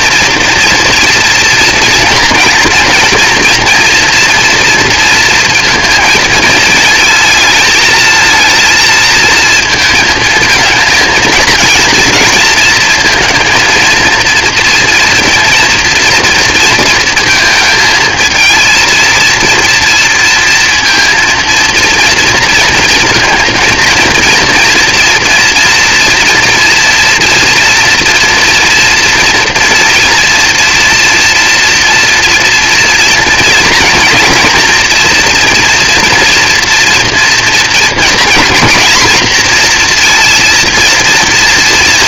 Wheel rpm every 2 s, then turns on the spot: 230, 230, 230, 230, 230, 230, 230, 230, 220, 230, 230, 230, 230, 230, 240, 230, 230, 240, 240, 240, 240.
none